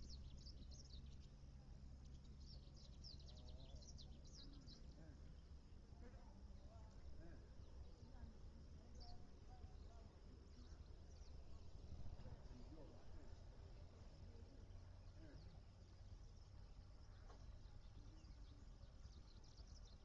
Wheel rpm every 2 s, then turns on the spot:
0, 0, 0, 0, 0, 0, 0, 0, 0, 0.
none